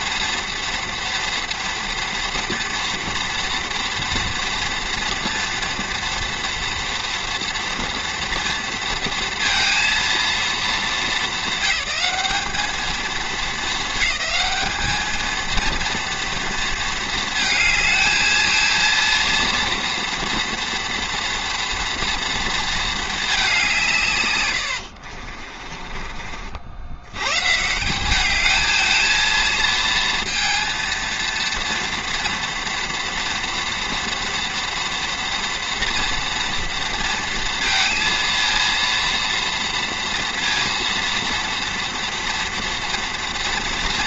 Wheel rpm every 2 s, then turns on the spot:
230, 230, 240, 230, 230, 220, 210, 220, 230, 230, 230, 220, 90, 70, 210, 230, 230, 230, 230, 230, 230, 230.
24-26